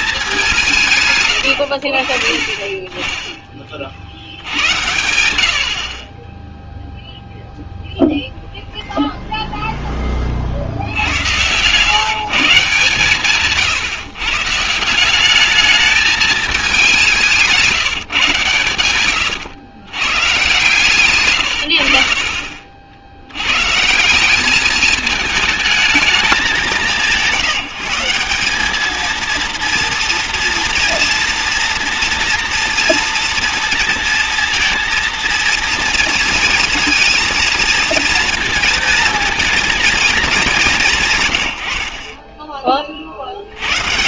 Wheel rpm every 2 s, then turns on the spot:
170, 30, 90, 0, 0, 60, 150, 150, 210, 110, 140, 50, 200, 190, 200, 230, 230, 230, 230, 230, 190, 30.
4-6